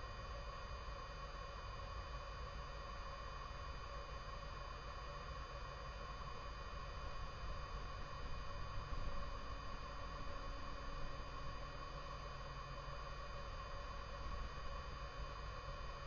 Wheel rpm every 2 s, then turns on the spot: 0, 0, 0, 0, 0, 0, 0, 0.
none